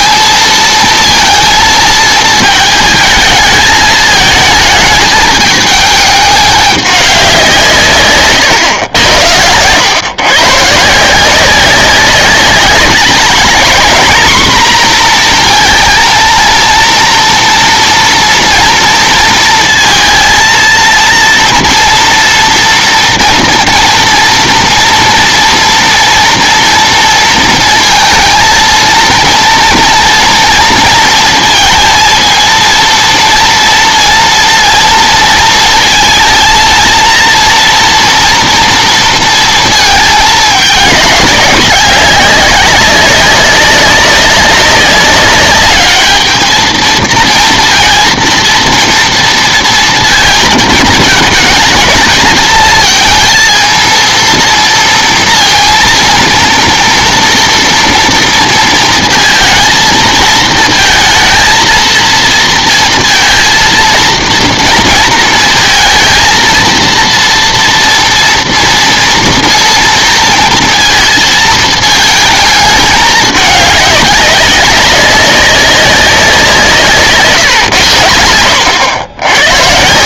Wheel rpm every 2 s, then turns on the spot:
230, 220, 220, 200, 110, 140, 200, 240, 230, 230, 230, 230, 230, 230, 220, 230, 230, 230, 230, 230, 210, 190, 200, 220, 230, 220, 220, 230, 230, 230, 230, 230, 230, 230, 230, 230, 220, 190, 170, 90.
78-80